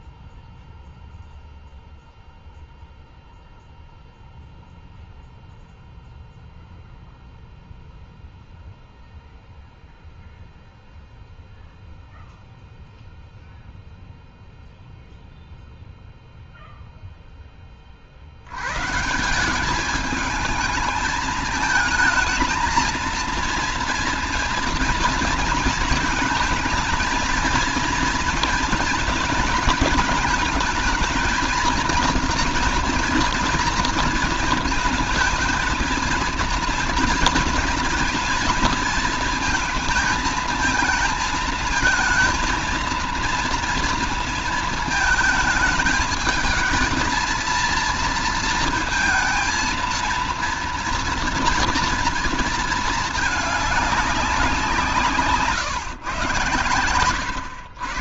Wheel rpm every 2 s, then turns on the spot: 0, 0, 0, 0, 0, 0, 0, 0, 0, 90, 220, 220, 230, 230, 230, 220, 230, 220, 230, 230, 220, 230, 230, 220, 230, 230, 230, 180, 120.
none